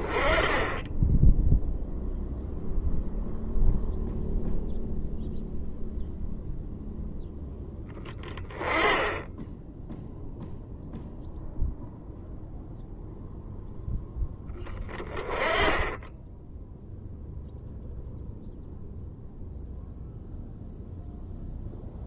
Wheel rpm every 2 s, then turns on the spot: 10, 0, 0, 0, 10, 0, 0, 20, 0, 0, 0.
none